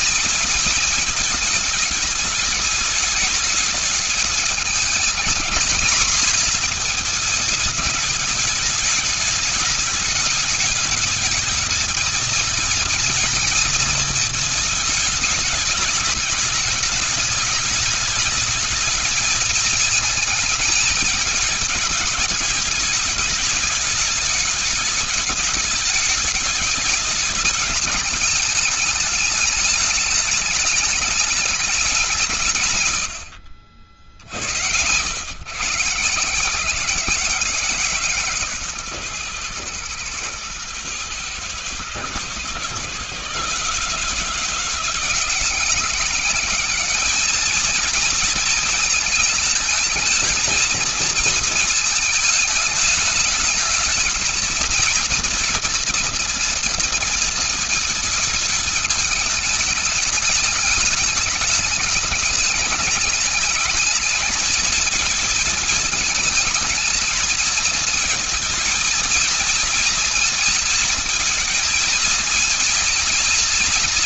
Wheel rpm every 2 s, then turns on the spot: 220, 210, 210, 230, 210, 210, 220, 220, 200, 210, 220, 210, 210, 210, 210, 210, 170, 80, 150, 140, 110, 120, 160, 200, 220, 220, 210, 220, 230, 220, 210, 210, 220, 220, 220, 220, 230.
32-34